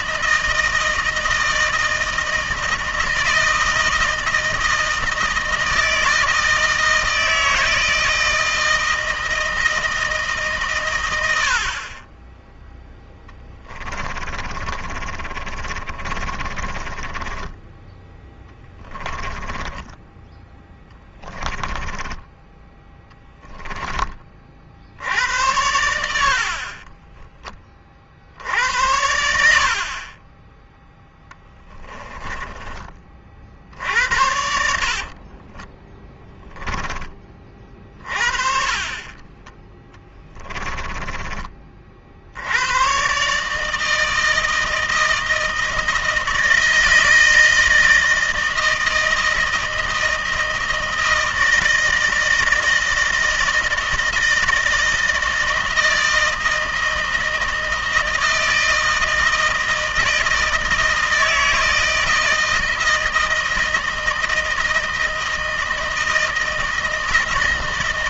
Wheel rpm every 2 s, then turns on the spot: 160, 160, 160, 160, 160, 120, 0, 30, 20, 20, 10, 10, 70, 30, 80, 10, 30, 60, 20, 30, 20, 110, 160, 160, 160, 160, 160, 160, 160, 160, 160, 160, 160, 160.
14-24 26-32 34-36 38-42